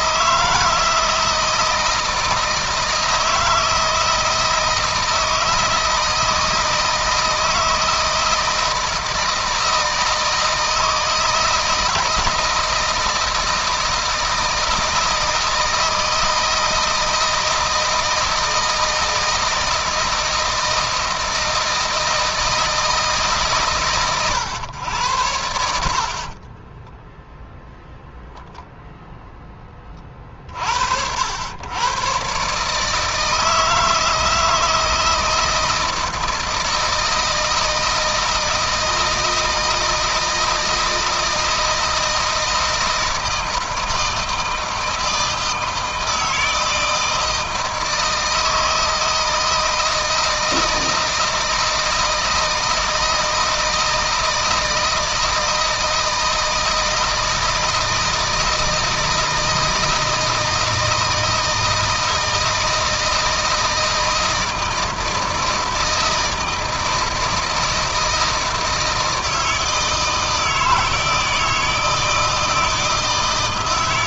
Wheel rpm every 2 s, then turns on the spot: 170, 160, 160, 160, 160, 160, 160, 160, 160, 160, 160, 160, 110, 20, 0, 60, 150, 160, 160, 160, 160, 160, 160, 160, 160, 160, 160, 160, 160, 160, 160, 160, 160, 160, 160, 160, 160.
26-28